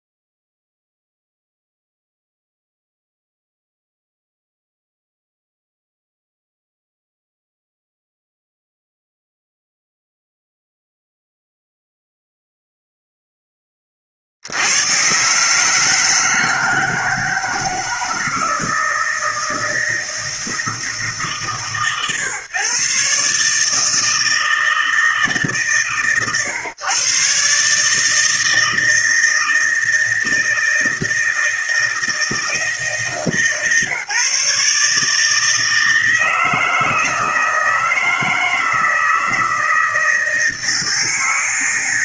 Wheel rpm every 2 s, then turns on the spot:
0, 0, 0, 0, 0, 0, 0, 70, 160, 160, 160, 130, 160, 120, 160, 160, 160, 150, 160, 160, 160.
none